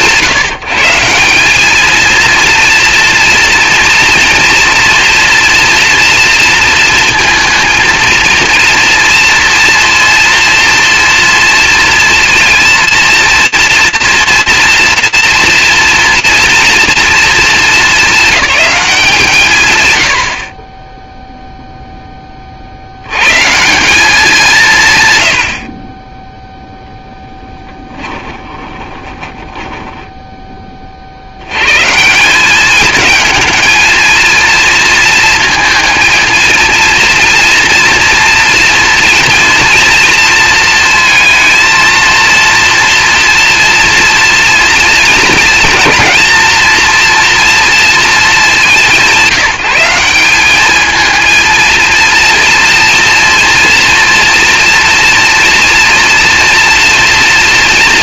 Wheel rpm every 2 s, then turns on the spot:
160, 230, 240, 230, 230, 230, 230, 230, 240, 190, 20, 60, 150, 0, 10, 50, 220, 230, 230, 230, 230, 230, 230, 230, 190, 220, 230, 230, 230.
28-30